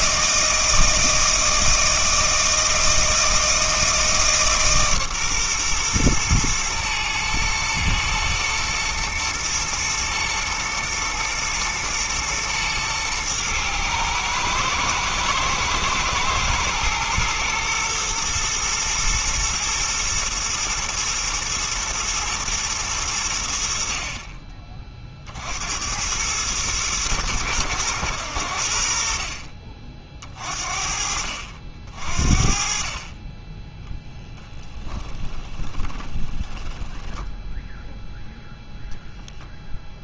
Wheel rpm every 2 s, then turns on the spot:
160, 160, 140, 120, 120, 120, 110, 110, 120, 120, 120, 110, 40, 110, 70, 50, 30, 10, 10, 0.
34-38